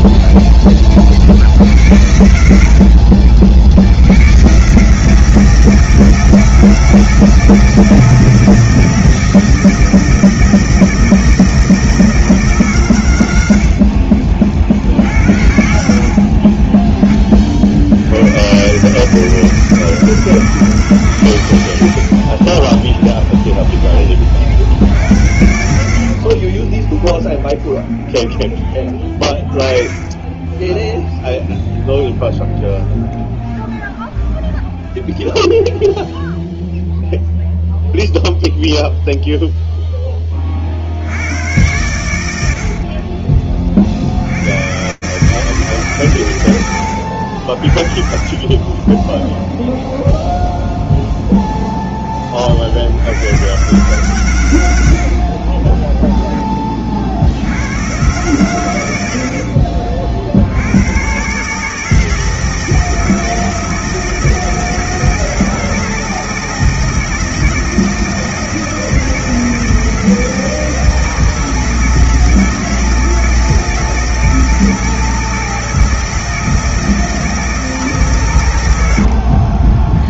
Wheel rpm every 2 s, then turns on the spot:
50, 60, 160, 160, 160, 160, 90, 80, 20, 150, 150, 10, 70, 20, 20, 0, 0, 0, 0, 0, 40, 90, 100, 100, 30, 0, 60, 90, 20, 110, 80, 160, 160, 160, 160, 160, 160, 160, 160, 120.
22-24 26-28 42-44 48-50